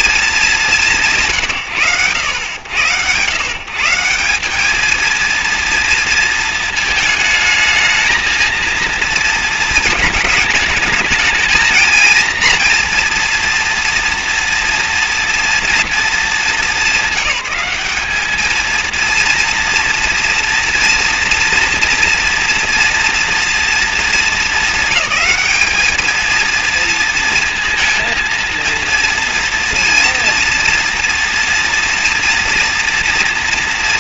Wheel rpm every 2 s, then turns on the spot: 190, 100, 210, 220, 230, 210, 240, 230, 210, 220, 230, 230, 200, 230, 230, 230, 230.
none